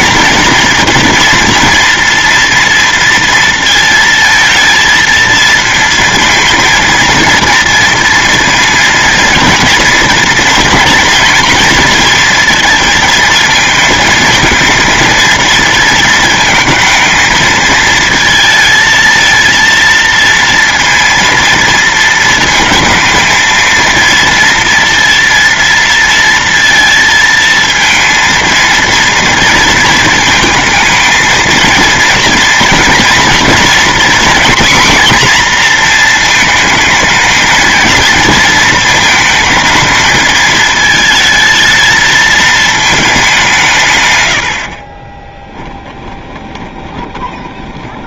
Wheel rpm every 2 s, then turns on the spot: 230, 230, 230, 230, 230, 230, 220, 230, 230, 220, 230, 230, 230, 230, 230, 220, 230, 240, 220, 230, 220, 220, 40, 20.
46-48